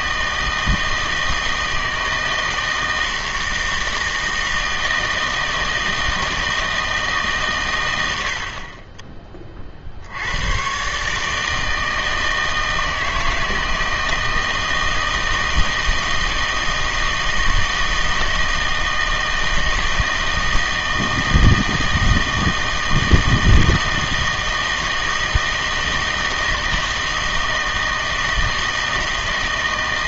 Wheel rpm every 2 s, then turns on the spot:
160, 160, 160, 160, 30, 120, 160, 160, 160, 160, 160, 160, 160, 160, 160.
none